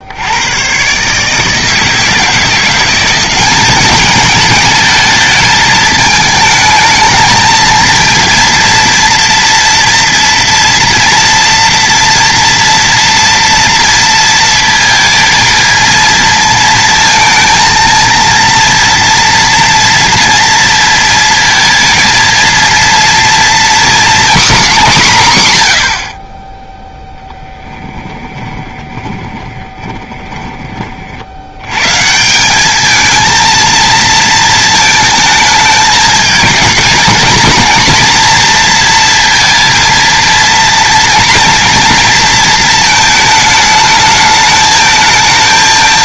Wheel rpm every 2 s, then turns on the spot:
130, 170, 210, 220, 230, 230, 230, 230, 230, 230, 230, 230, 230, 10, 20, 30, 200, 220, 220, 230, 230, 220, 220.
28-30